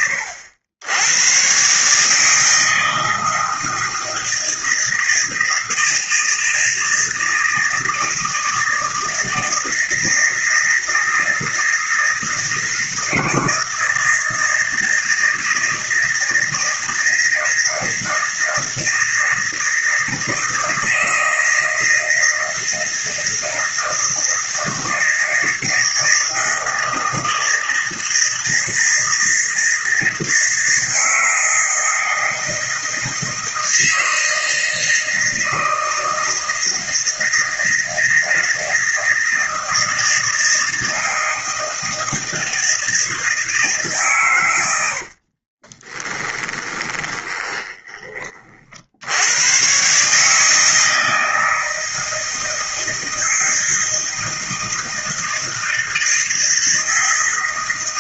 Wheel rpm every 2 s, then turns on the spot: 100, 160, 160, 160, 160, 160, 160, 160, 160, 160, 160, 160, 160, 160, 160, 160, 160, 160, 160, 160, 160, 160, 70, 20, 70, 160, 160, 160, 160.
46-48